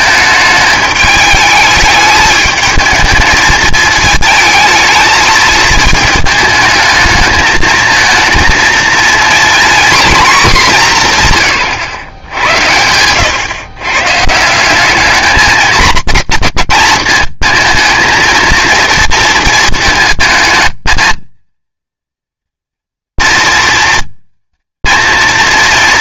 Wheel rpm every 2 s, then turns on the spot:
210, 220, 220, 220, 230, 210, 100, 190, 230, 230, 220, 230, 230.
none